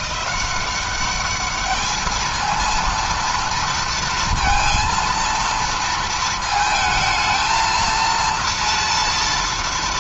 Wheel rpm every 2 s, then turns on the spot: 200, 230, 230, 220, 230.
none